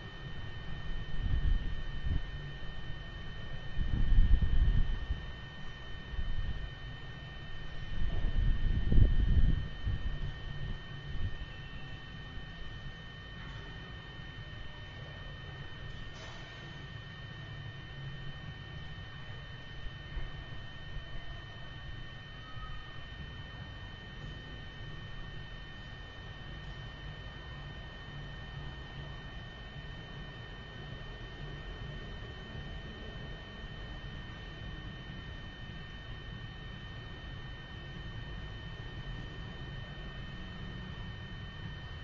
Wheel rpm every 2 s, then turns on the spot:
0, 0, 0, 0, 0, 0, 0, 0, 0, 0, 0, 0, 0, 0, 0, 0, 0, 0, 0, 0, 0.
none